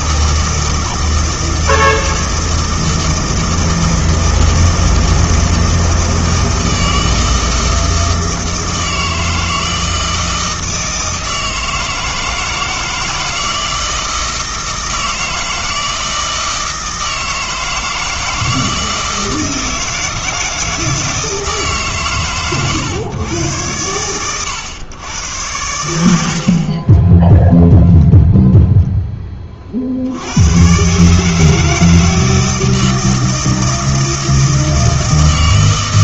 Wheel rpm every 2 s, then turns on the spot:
160, 160, 160, 160, 160, 160, 160, 160, 160, 160, 160, 130, 110, 30, 0, 120, 160, 160.
none